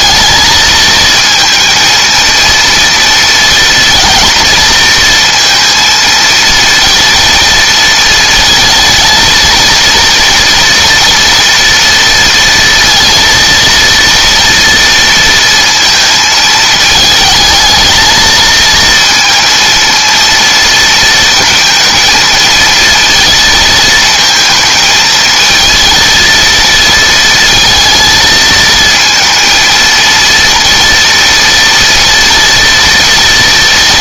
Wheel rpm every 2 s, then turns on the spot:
230, 230, 230, 230, 230, 230, 230, 230, 220, 220, 230, 230, 220, 230, 230, 230, 230.
none